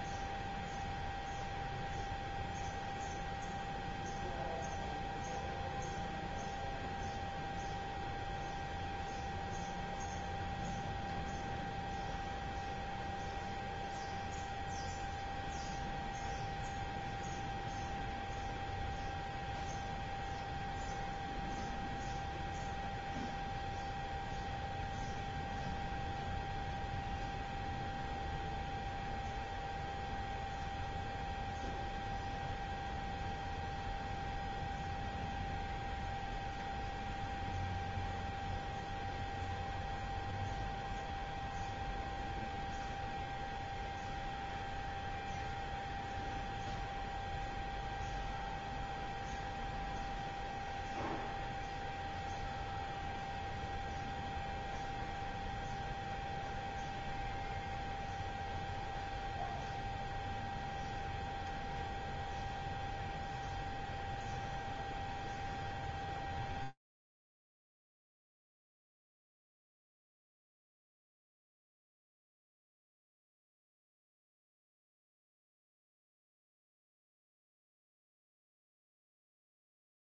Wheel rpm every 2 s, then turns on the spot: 0, 0, 0, 0, 0, 0, 0, 0, 0, 0, 0, 0, 0, 0, 0, 0, 0, 0, 0, 0, 0, 0, 0, 0, 0, 0, 0, 0, 0, 0, 0, 0, 0, 0, 0, 0, 0, 0, 0, 0.
none